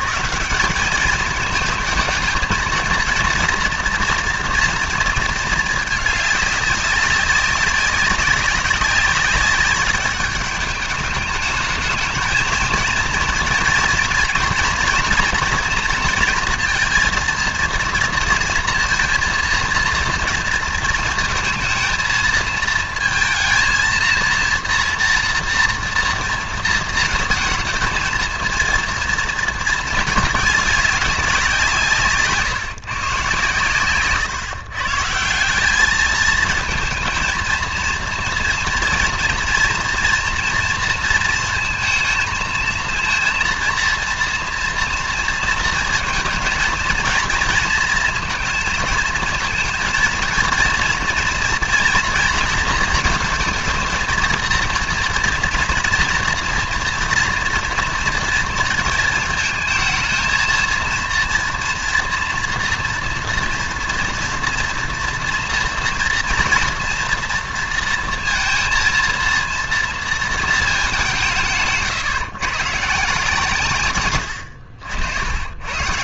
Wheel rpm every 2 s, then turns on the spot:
190, 220, 230, 200, 200, 210, 220, 230, 230, 230, 230, 220, 230, 230, 230, 200, 140, 130, 220, 230, 230, 230, 240, 230, 220, 230, 230, 230, 230, 230, 230, 230, 230, 240, 230, 220, 150, 80.
none